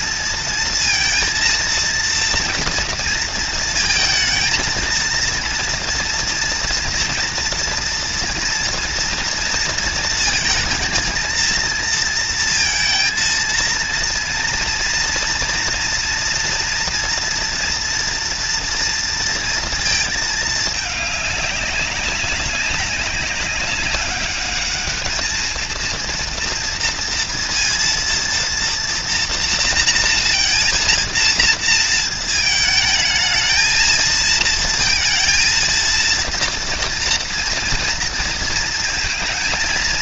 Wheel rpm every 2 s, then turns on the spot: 230, 230, 230, 230, 230, 230, 230, 230, 230, 230, 210, 200, 210, 230, 230, 230, 220, 230, 230, 230.
none